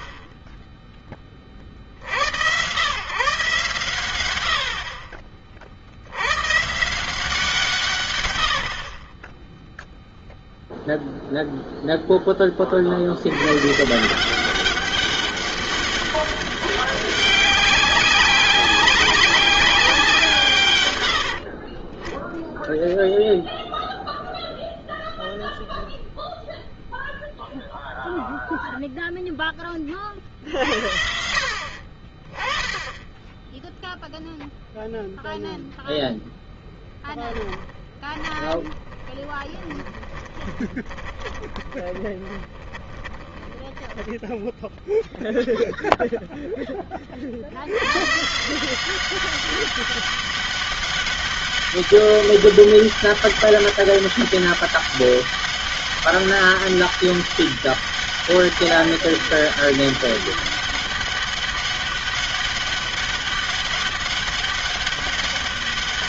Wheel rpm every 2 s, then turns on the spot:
50, 110, 70, 140, 0, 0, 120, 200, 200, 200, 50, 0, 0, 0, 10, 60, 20, 0, 20, 20, 20, 10, 0, 50, 190, 200, 200, 200, 200, 200, 200, 200, 200.
36-44